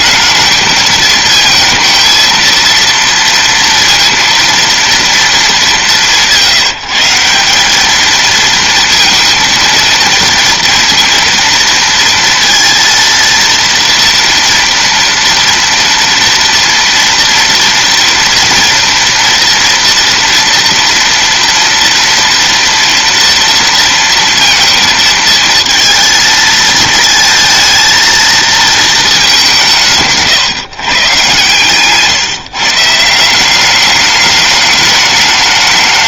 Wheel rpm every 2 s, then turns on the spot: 220, 230, 230, 180, 230, 230, 230, 230, 230, 230, 230, 230, 230, 230, 230, 140, 150, 210.
none